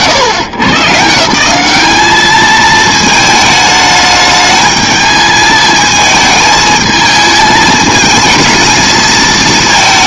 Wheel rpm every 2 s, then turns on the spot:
130, 220, 210, 220, 220.
none